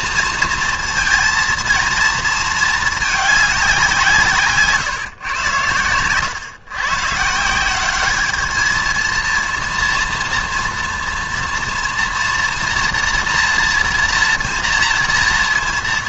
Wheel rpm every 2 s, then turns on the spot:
230, 220, 160, 120, 210, 230, 230, 230.
none